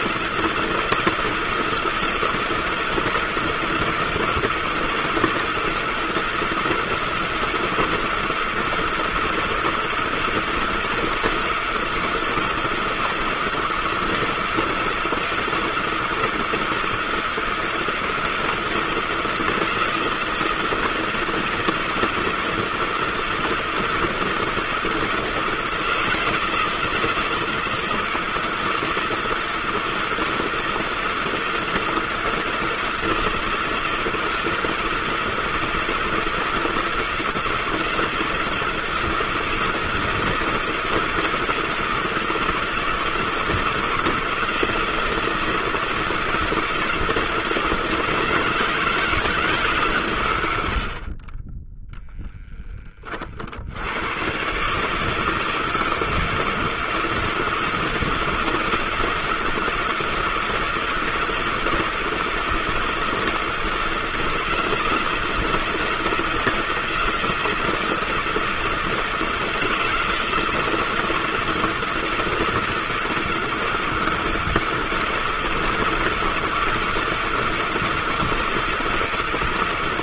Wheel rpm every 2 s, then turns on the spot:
160, 160, 170, 160, 160, 160, 160, 160, 160, 160, 160, 160, 160, 160, 160, 160, 160, 160, 160, 160, 160, 160, 160, 160, 160, 70, 10, 140, 160, 160, 160, 160, 160, 170, 160, 160, 160, 160, 160, 160.
none